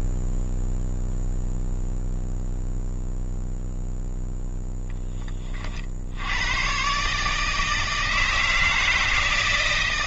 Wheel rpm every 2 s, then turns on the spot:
0, 0, 0, 120, 160.
none